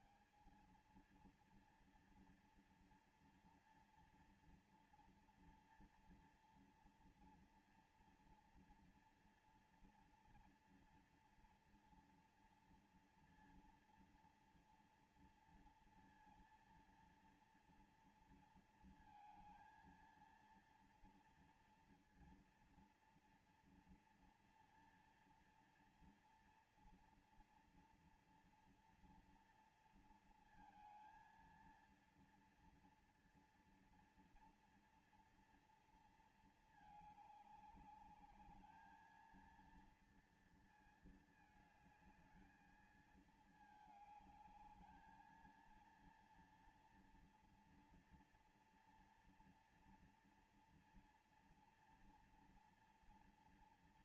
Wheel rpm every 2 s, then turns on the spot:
160, 230, 230, 230, 230, 230, 230, 240, 230, 230, 230, 230, 230, 230, 240, 230, 230, 230, 230, 210, 230, 220, 220, 230, 230, 230, 230.
none